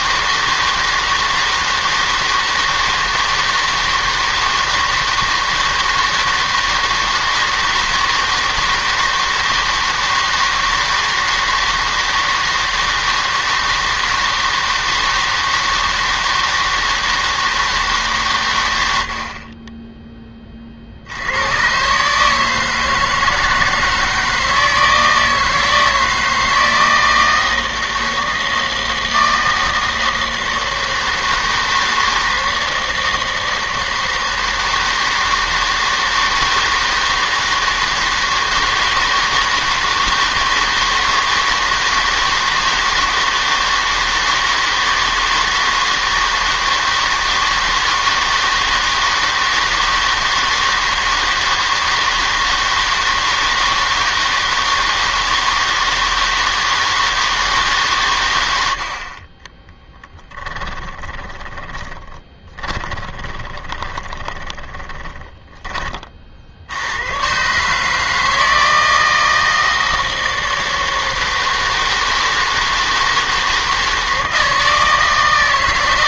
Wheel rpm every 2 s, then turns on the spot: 160, 160, 160, 160, 160, 160, 160, 160, 160, 110, 30, 160, 160, 160, 160, 160, 160, 160, 160, 160, 160, 160, 160, 160, 160, 160, 160, 160, 160, 80, 10, 20, 20, 70, 160, 160, 160, 160.
60-66